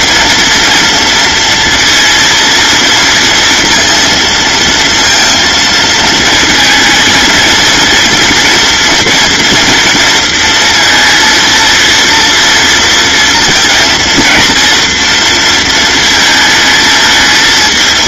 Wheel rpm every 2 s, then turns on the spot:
230, 230, 230, 230, 240, 230, 230, 230, 210.
none